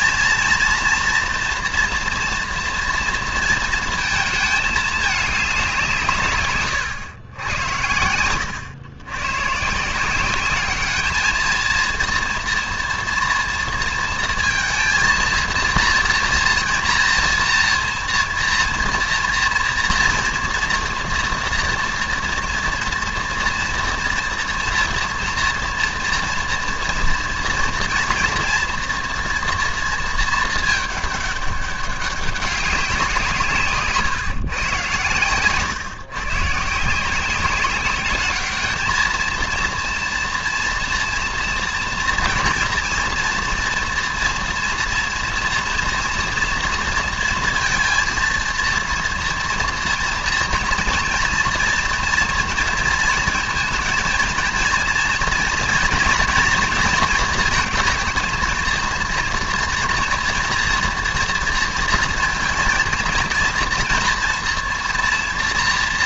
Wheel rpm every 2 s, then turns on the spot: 240, 230, 220, 130, 100, 200, 230, 230, 230, 240, 230, 230, 230, 230, 230, 220, 190, 130, 150, 220, 240, 230, 230, 230, 230, 240, 230, 230, 240, 230, 230, 230, 240.
none